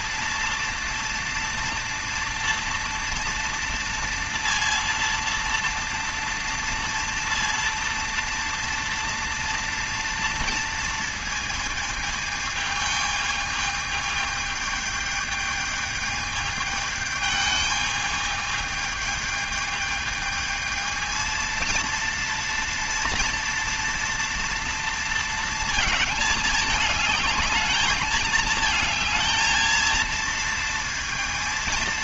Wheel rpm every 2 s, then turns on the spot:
230, 230, 230, 230, 230, 230, 220, 210, 210, 220, 220, 230, 240, 210, 220, 230.
none